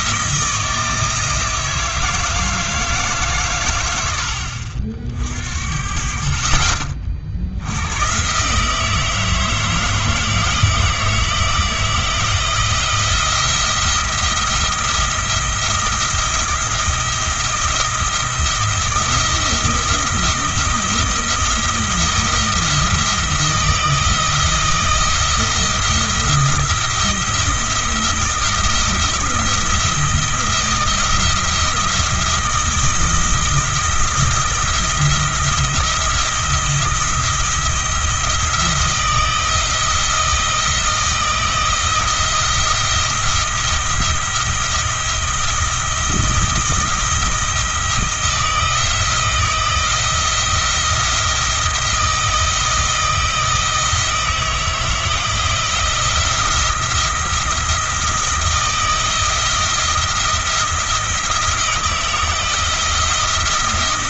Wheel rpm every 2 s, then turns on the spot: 160, 160, 60, 40, 150, 160, 170, 170, 170, 170, 170, 160, 170, 170, 170, 170, 170, 170, 170, 170, 160, 170, 170, 170, 170, 170, 170, 160, 170, 170, 170, 170.
none